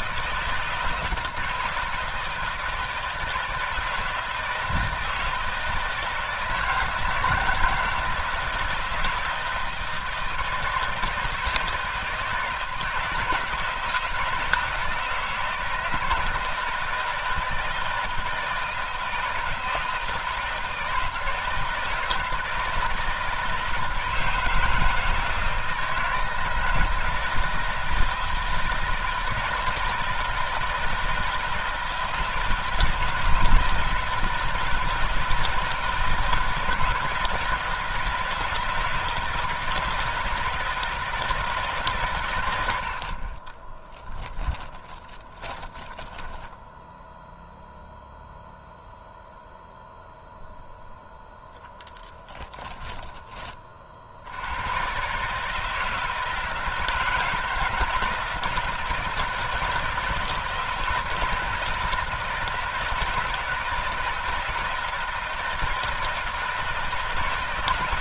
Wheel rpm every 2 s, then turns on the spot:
160, 160, 160, 160, 160, 160, 160, 160, 160, 160, 160, 160, 160, 160, 160, 160, 160, 160, 160, 160, 160, 120, 10, 10, 0, 0, 10, 70, 160, 160, 160, 160, 160, 160.
44-48 52-54